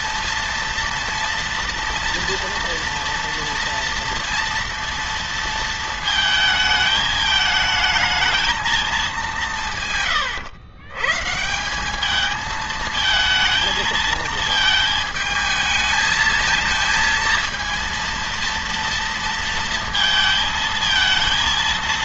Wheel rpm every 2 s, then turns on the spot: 230, 230, 230, 220, 220, 130, 220, 220, 230, 230, 220.
none